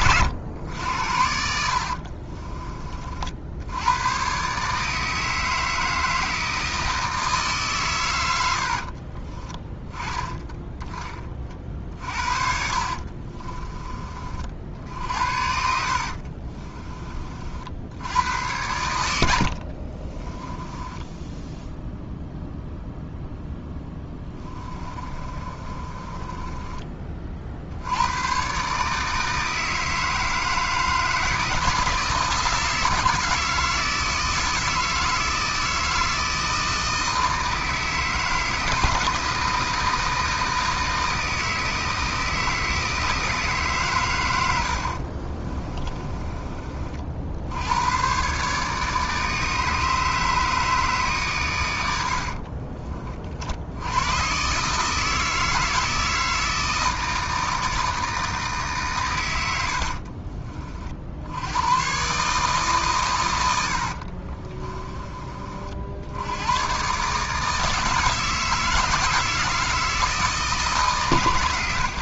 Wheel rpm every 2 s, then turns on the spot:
90, 30, 150, 160, 60, 20, 50, 50, 30, 100, 10, 0, 30, 30, 140, 160, 170, 160, 160, 160, 160, 160, 70, 40, 150, 150, 20, 150, 160, 140, 50, 150, 20, 130, 160, 160.
8-10 12-14 20-22 24-26 44-46